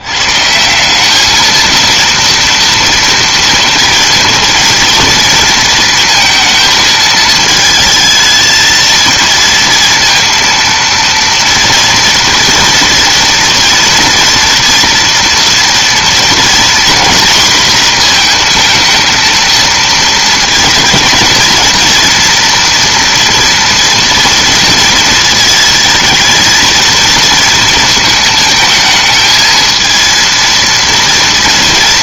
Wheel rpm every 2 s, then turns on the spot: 150, 230, 230, 220, 220, 230, 230, 240, 240, 230, 230, 230, 230, 220, 220, 230.
none